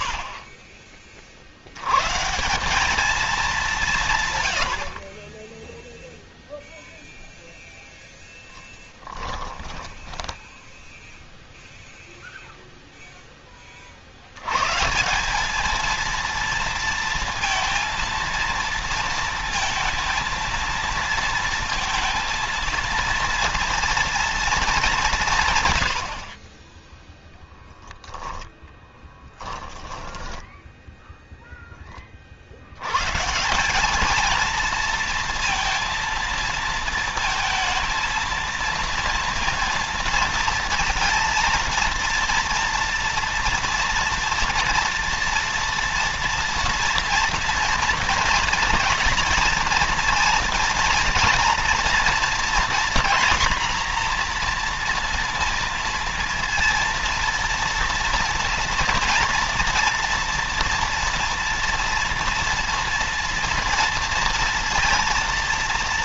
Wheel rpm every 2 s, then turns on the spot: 100, 180, 0, 0, 10, 0, 10, 180, 230, 230, 230, 230, 190, 10, 10, 0, 130, 230, 230, 230, 230, 230, 230, 230, 240, 230, 240, 230, 230, 230, 230, 230, 230.
8-10 28-30